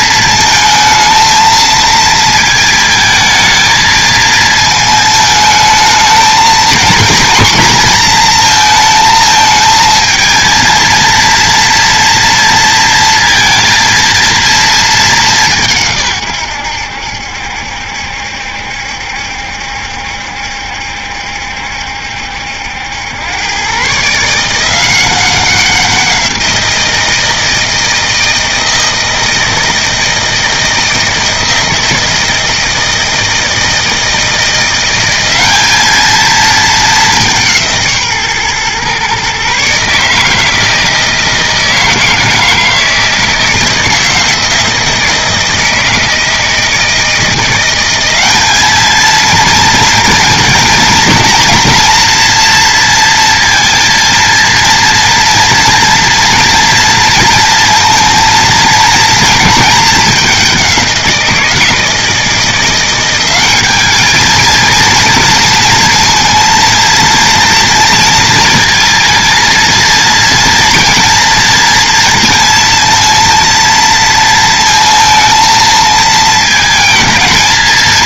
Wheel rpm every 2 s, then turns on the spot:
230, 220, 220, 230, 230, 230, 230, 220, 100, 70, 70, 80, 170, 170, 160, 160, 160, 170, 210, 130, 160, 160, 160, 160, 220, 230, 230, 230, 230, 230, 190, 180, 230, 230, 230, 230, 230, 230, 220.
none